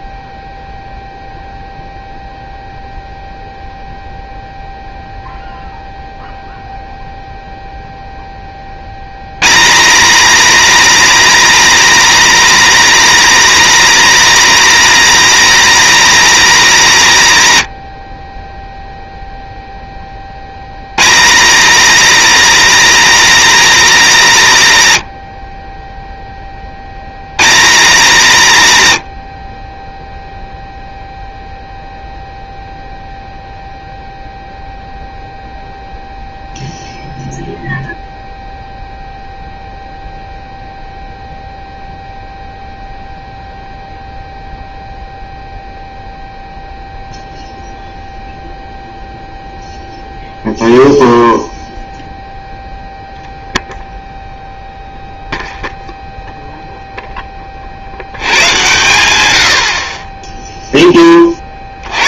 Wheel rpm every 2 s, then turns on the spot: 0, 0, 0, 0, 70, 260, 260, 250, 200, 0, 120, 250, 140, 60, 120, 0, 0, 0, 0, 0, 0, 0, 0, 0, 0, 0, 0, 0, 0, 110, 10.
none